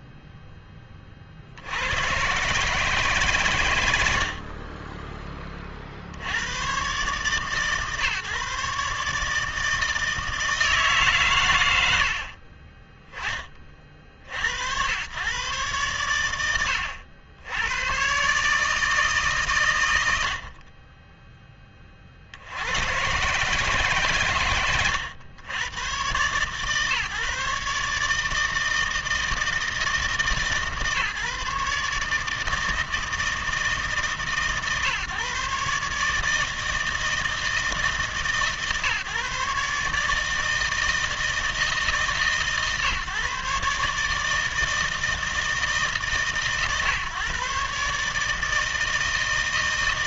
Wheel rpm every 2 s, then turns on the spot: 10, 150, 30, 120, 150, 160, 20, 90, 80, 150, 40, 90, 100, 140, 160, 150, 160, 140, 160, 140, 160, 140, 160, 140, 160.
none